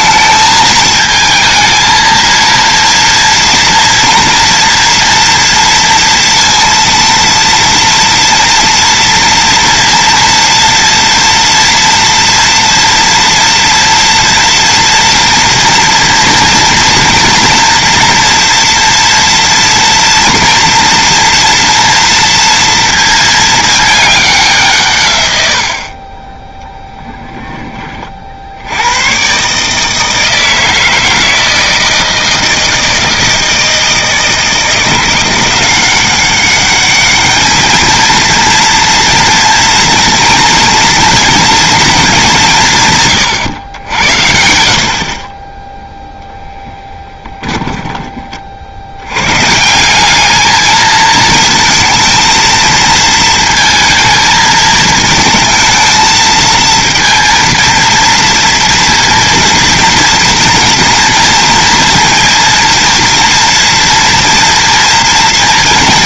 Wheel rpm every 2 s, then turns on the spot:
220, 230, 230, 230, 230, 240, 230, 230, 240, 230, 230, 230, 160, 10, 70, 160, 160, 170, 200, 230, 230, 160, 60, 10, 50, 220, 230, 220, 230, 230, 230, 230, 230.
none